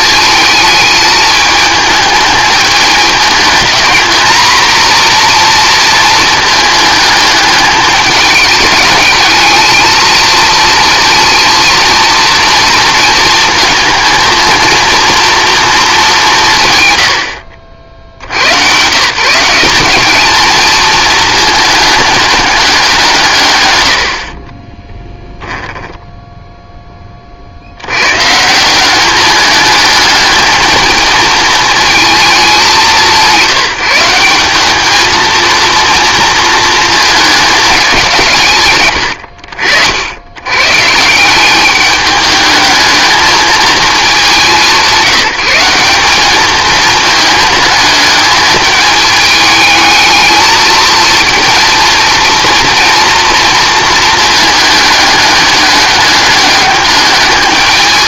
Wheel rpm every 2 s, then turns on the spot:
220, 210, 230, 220, 210, 230, 230, 230, 150, 110, 220, 200, 30, 10, 170, 220, 200, 200, 230, 140, 120, 220, 200, 220, 210, 220, 230, 210, 200.
24-26